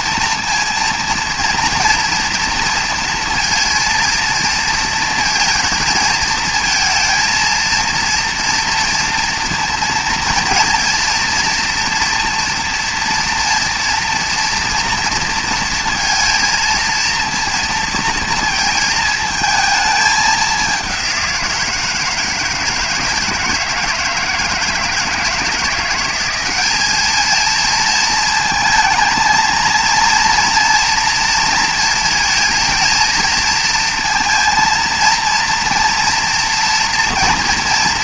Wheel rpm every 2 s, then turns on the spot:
230, 230, 230, 230, 230, 230, 230, 230, 230, 220, 190, 160, 160, 210, 230, 230, 230, 230, 230.
none